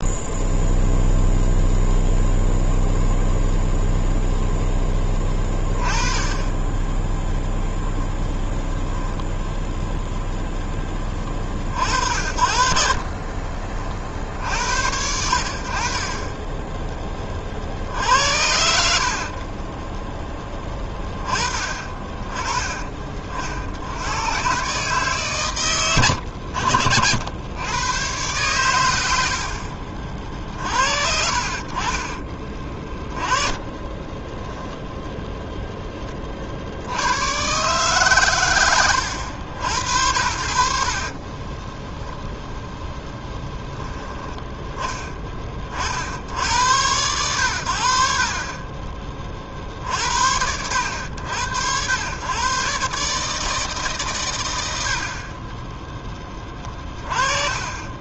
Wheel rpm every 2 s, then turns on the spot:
0, 0, 0, 10, 0, 10, 50, 70, 10, 70, 10, 30, 130, 80, 120, 50, 20, 10, 70, 100, 60, 0, 10, 90, 30, 90, 130, 80, 30.
12-14 16-18 32-34